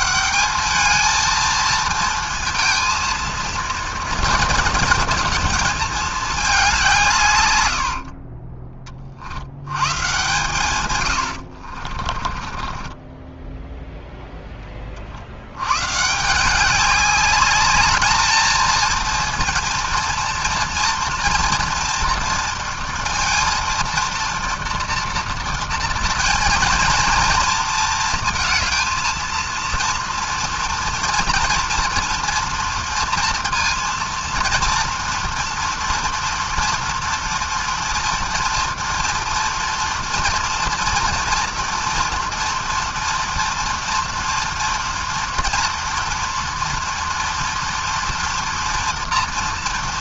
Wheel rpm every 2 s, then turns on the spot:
210, 230, 230, 200, 40, 110, 20, 0, 170, 220, 230, 230, 240, 230, 230, 230, 230, 240, 230, 230, 230, 230, 230, 230, 230.
8-10 12-14